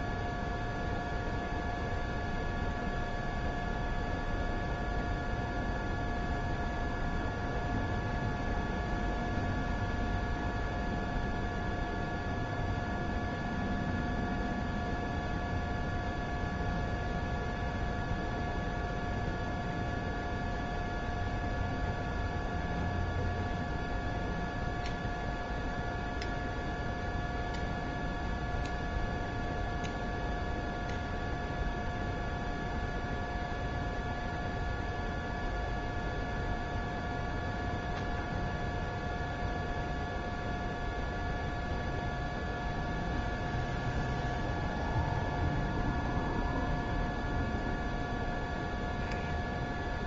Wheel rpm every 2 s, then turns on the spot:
0, 0, 0, 0, 0, 0, 0, 0, 0, 0, 0, 0, 0, 0, 0, 0, 0, 0, 0, 0, 0, 0, 0, 0, 0.
none